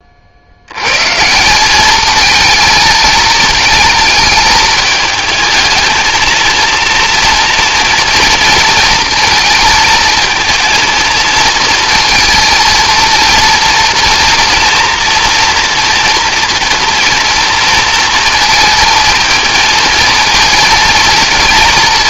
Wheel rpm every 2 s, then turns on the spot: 120, 230, 220, 230, 230, 230, 230, 230, 230, 230, 230.
none